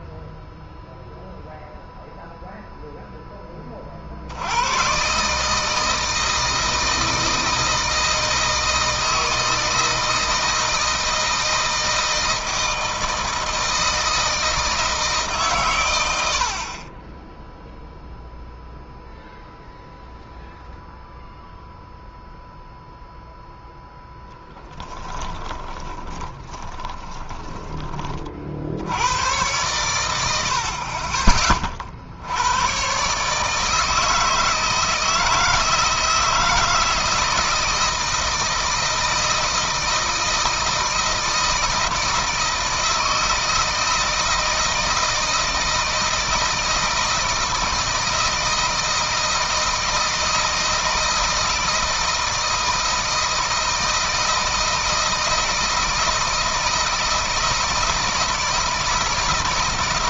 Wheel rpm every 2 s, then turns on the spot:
0, 0, 100, 160, 160, 160, 160, 160, 40, 0, 0, 0, 10, 20, 70, 50, 110, 160, 160, 160, 160, 160, 160, 160, 160, 160, 160, 160, 160, 160.
24-28